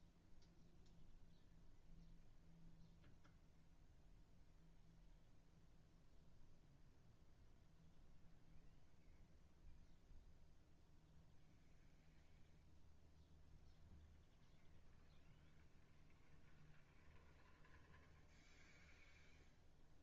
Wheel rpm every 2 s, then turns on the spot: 0, 0, 0, 0, 0, 0, 0, 0, 0, 0.
none